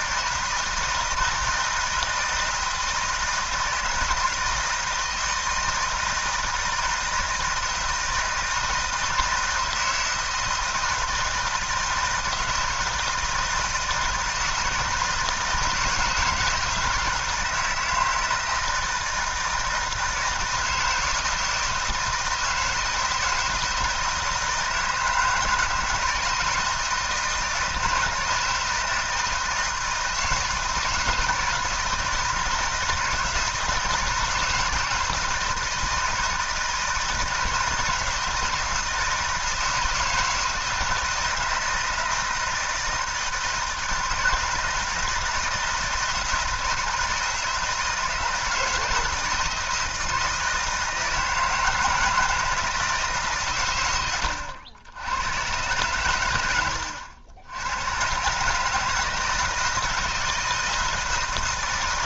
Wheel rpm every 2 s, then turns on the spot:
160, 160, 160, 160, 160, 160, 160, 160, 160, 160, 160, 160, 160, 160, 160, 160, 160, 170, 160, 170, 160, 160, 160, 170, 160, 160, 160, 90, 100, 150, 160.
none